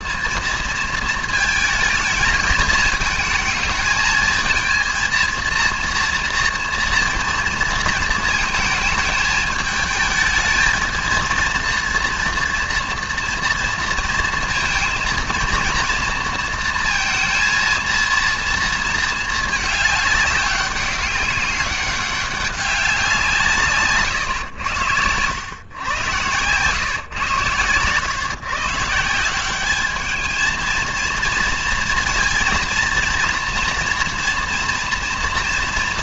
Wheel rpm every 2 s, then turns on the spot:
230, 220, 230, 230, 220, 220, 230, 230, 230, 230, 200, 190, 100, 120, 140, 220, 230, 230.
none